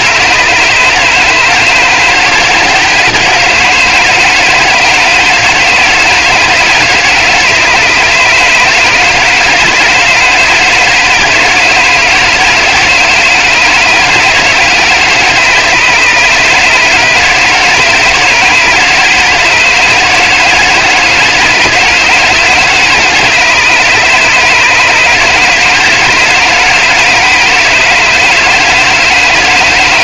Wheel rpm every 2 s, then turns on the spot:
160, 160, 160, 160, 150, 160, 160, 160, 160, 160, 160, 160, 150, 160, 160.
none